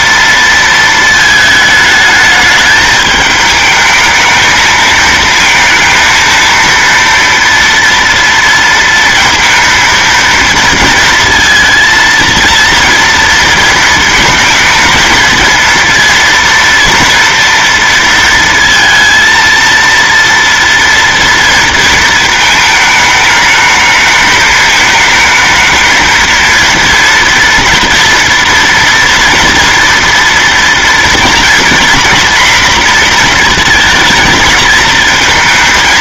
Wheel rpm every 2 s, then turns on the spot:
230, 210, 220, 230, 230, 230, 230, 220, 230, 230, 230, 220, 220, 230, 240, 240, 240, 220.
none